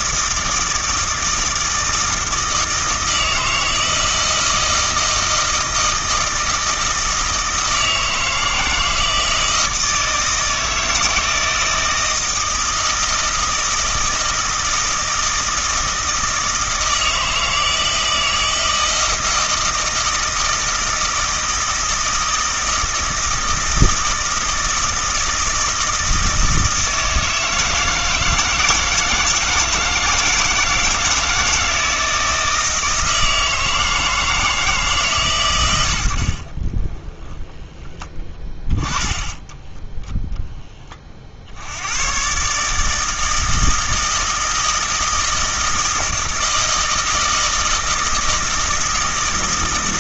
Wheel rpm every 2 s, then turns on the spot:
160, 160, 160, 160, 160, 160, 160, 160, 160, 160, 160, 160, 160, 160, 160, 160, 160, 160, 30, 20, 20, 150, 160, 160, 160.
36-38